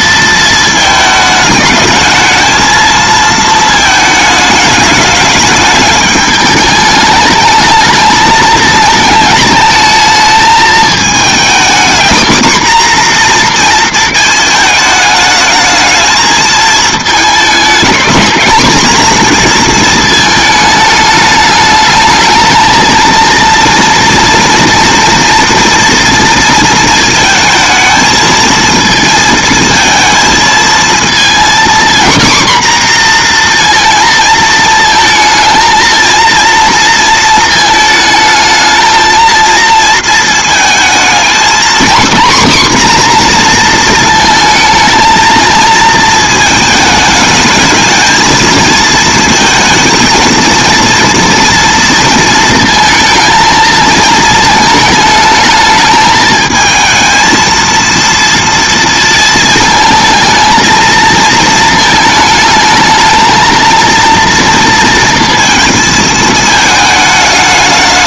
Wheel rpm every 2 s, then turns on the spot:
220, 230, 210, 210, 220, 220, 250, 220, 220, 240, 220, 220, 230, 230, 220, 220, 250, 220, 230, 220, 220, 260, 230, 220, 220, 230, 230, 220, 220, 230, 220, 220, 230, 220.
none